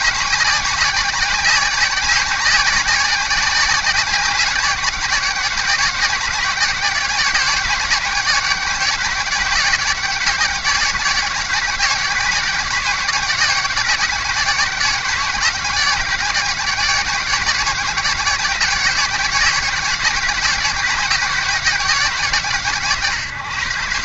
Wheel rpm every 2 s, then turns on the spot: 180, 180, 180, 180, 180, 170, 170, 170, 170, 170, 170, 160.
none